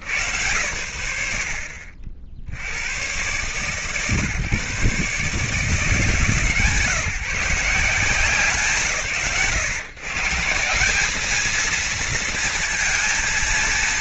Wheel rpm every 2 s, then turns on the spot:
50, 130, 150, 160, 150, 230, 230.
none